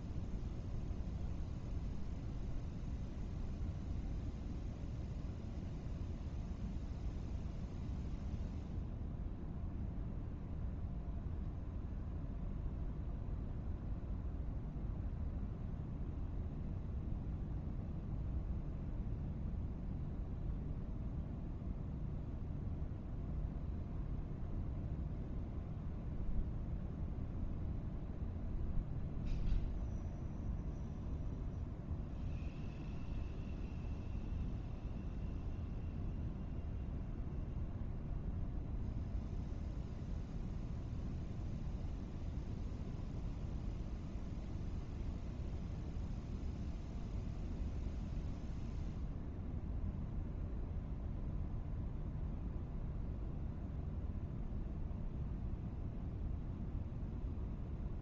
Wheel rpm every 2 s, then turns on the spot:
0, 0, 0, 0, 0, 0, 0, 0, 0, 0, 0, 0, 0, 0, 0, 0, 0, 0, 0, 0, 0, 0, 0, 0, 0, 0, 0, 0, 0.
none